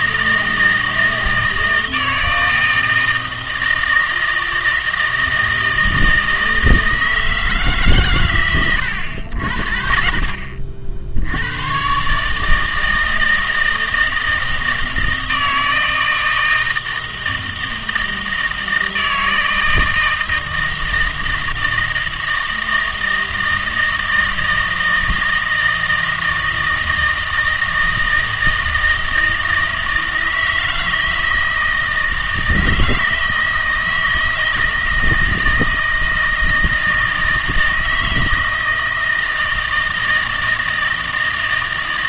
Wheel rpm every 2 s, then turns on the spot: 160, 160, 160, 160, 110, 60, 160, 160, 160, 160, 160, 160, 160, 160, 160, 160, 160, 160, 160, 160, 160.
none